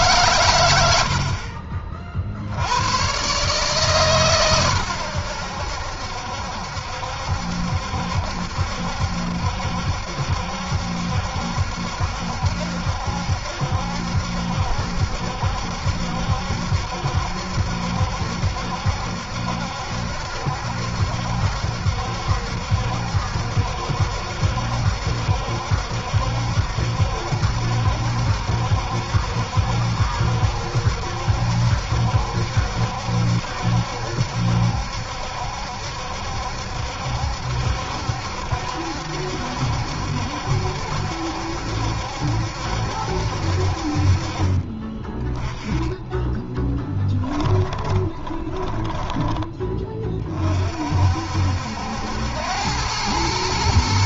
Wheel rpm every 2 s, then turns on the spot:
90, 90, 110, 70, 70, 70, 70, 70, 70, 70, 70, 70, 70, 70, 70, 70, 70, 70, 70, 70, 70, 70, 30, 10, 20, 50, 100.
46-50